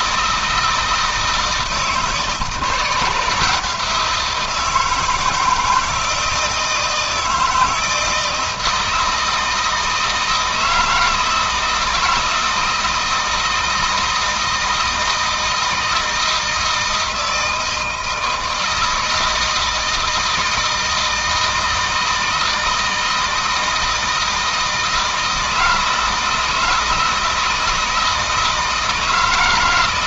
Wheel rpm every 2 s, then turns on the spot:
160, 170, 160, 160, 160, 160, 160, 160, 160, 160, 160, 160, 160, 160, 160.
none